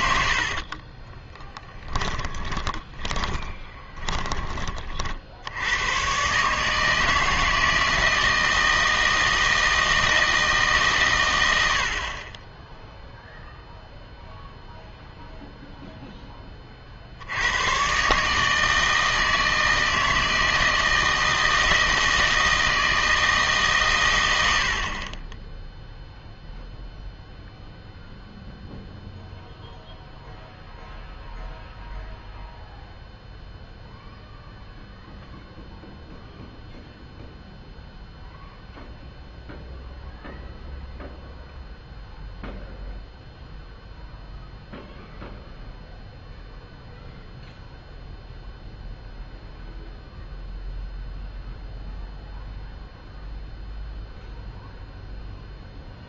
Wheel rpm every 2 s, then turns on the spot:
50, 10, 30, 150, 160, 150, 10, 0, 30, 160, 160, 160, 70, 0, 0, 0, 0, 0, 0, 0, 0, 0, 0, 0, 0, 0, 0, 0.
0-4